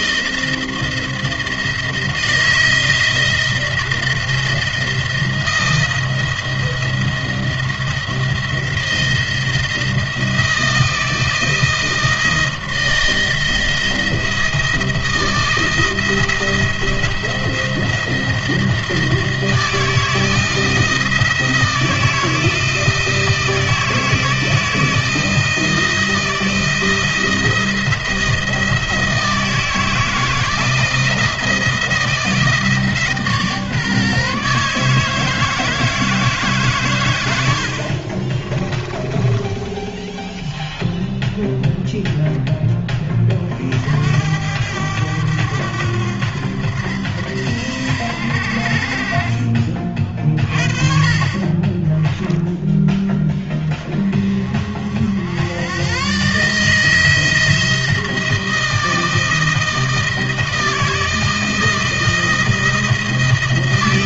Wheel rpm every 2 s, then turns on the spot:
170, 160, 170, 170, 170, 160, 160, 170, 170, 160, 160, 170, 160, 170, 160, 160, 150, 150, 130, 20, 0, 10, 90, 90, 50, 40, 20, 60, 160, 160, 160, 160.
38-40 50-52